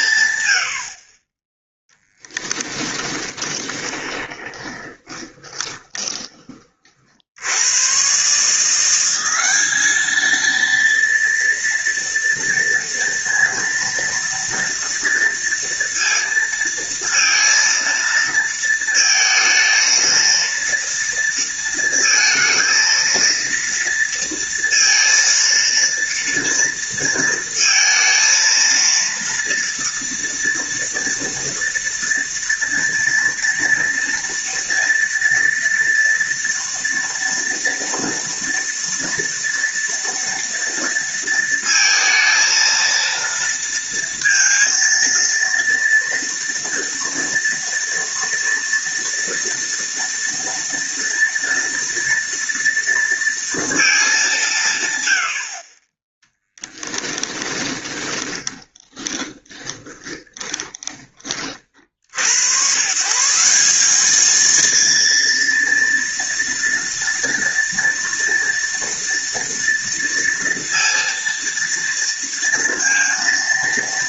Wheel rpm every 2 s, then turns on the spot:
40, 10, 20, 40, 180, 230, 230, 230, 230, 230, 230, 230, 230, 230, 230, 230, 230, 230, 230, 230, 230, 230, 230, 230, 230, 240, 230, 120, 20, 20, 20, 140, 230, 230, 230, 230, 230.
2-6 56-62